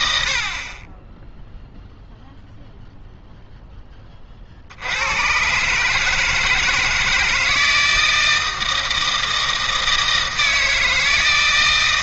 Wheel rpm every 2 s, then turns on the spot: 50, 0, 60, 160, 160, 160.
none